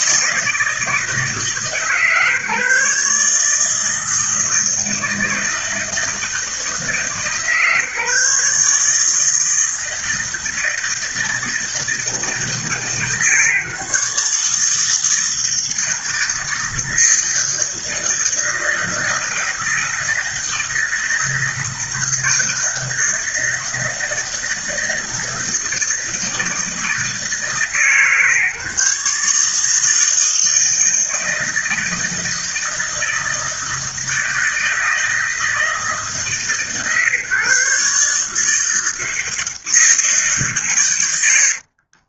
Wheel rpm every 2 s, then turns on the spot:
160, 150, 160, 150, 160, 160, 160, 160, 160, 160, 160, 160, 160, 160, 150, 160, 160, 160, 140, 160, 90.
40-42